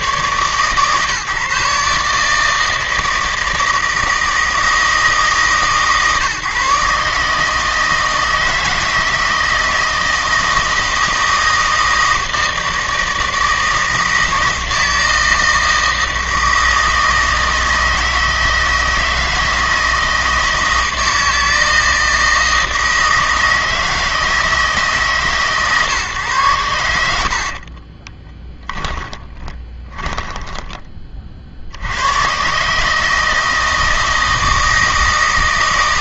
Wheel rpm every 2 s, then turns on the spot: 130, 160, 160, 140, 160, 160, 160, 160, 160, 160, 160, 160, 150, 90, 20, 20, 150, 160.
28-30